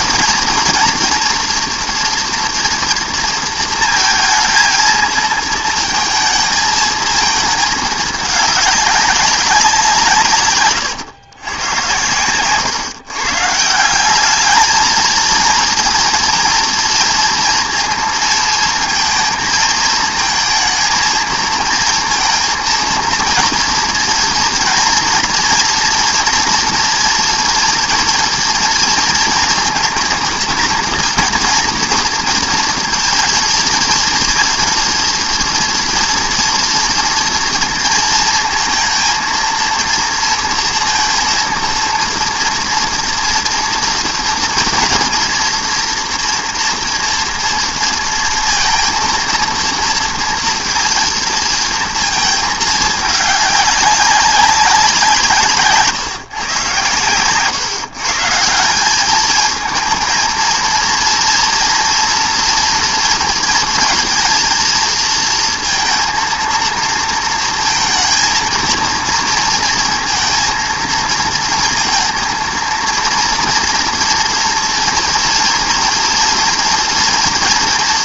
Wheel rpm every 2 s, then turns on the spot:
230, 230, 220, 220, 200, 130, 130, 220, 230, 230, 230, 230, 230, 230, 230, 230, 230, 230, 230, 230, 230, 230, 240, 240, 230, 230, 220, 190, 120, 170, 230, 240, 230, 230, 230, 230, 230, 230, 230.
none